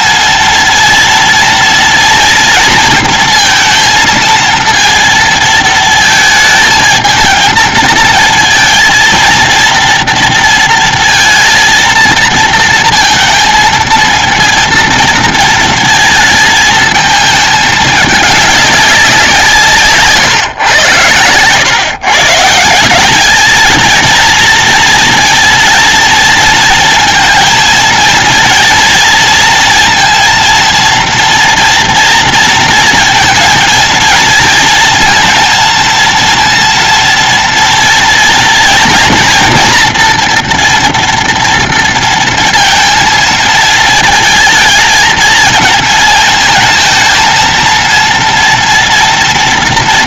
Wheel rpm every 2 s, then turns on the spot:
230, 230, 230, 220, 230, 230, 230, 230, 220, 180, 110, 180, 230, 230, 230, 230, 230, 230, 230, 230, 230, 220, 220, 220, 240.
none